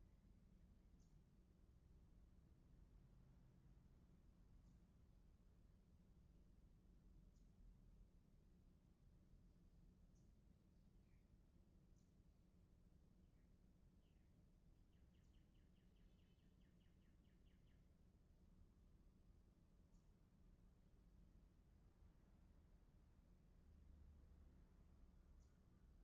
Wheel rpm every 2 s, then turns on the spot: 0, 0, 0, 0, 0, 0, 0, 0, 0, 0, 0, 0, 0.
none